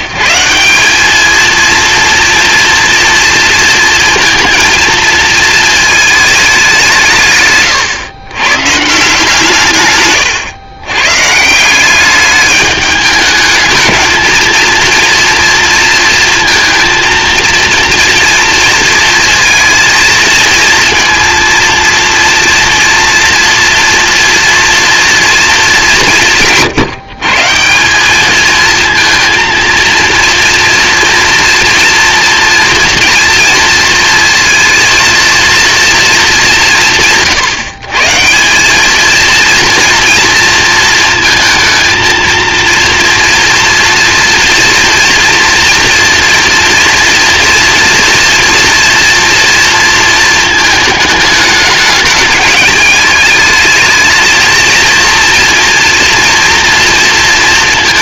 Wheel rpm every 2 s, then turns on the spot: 180, 230, 230, 200, 140, 120, 210, 230, 230, 230, 230, 230, 230, 130, 220, 230, 230, 230, 160, 190, 230, 230, 230, 230, 230, 220, 210, 230, 230.
none